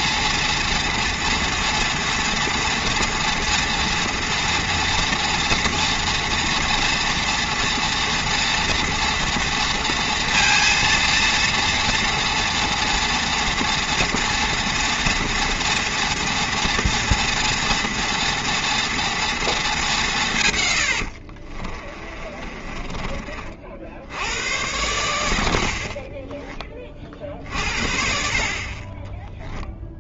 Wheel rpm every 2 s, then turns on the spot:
230, 240, 230, 230, 240, 230, 230, 230, 230, 230, 100, 30, 100, 30, 30.
20-24